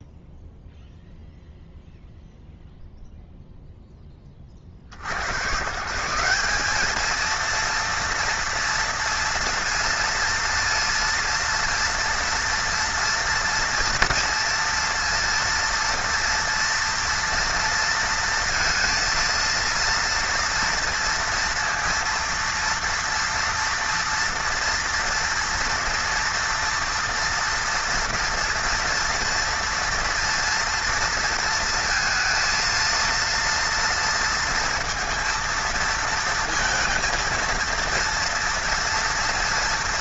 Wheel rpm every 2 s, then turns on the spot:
0, 0, 40, 200, 230, 230, 230, 230, 230, 230, 230, 230, 230, 230, 230, 230, 230, 230, 230, 230.
none